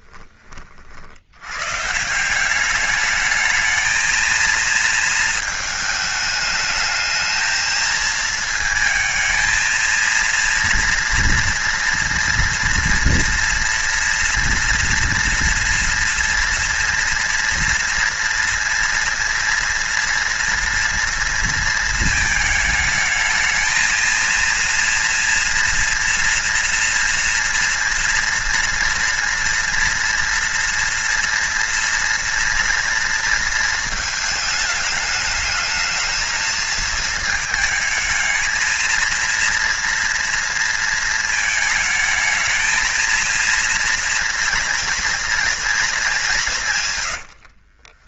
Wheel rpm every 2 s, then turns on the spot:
70, 190, 230, 220, 220, 230, 240, 230, 230, 240, 230, 220, 230, 230, 230, 230, 230, 210, 220, 220, 230, 220, 230, 150.
none